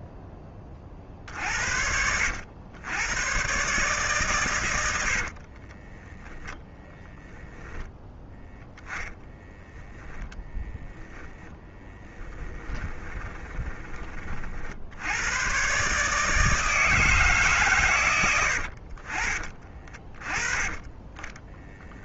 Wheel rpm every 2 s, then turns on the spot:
30, 90, 110, 0, 0, 0, 10, 50, 150, 90, 20.
12-14 20-22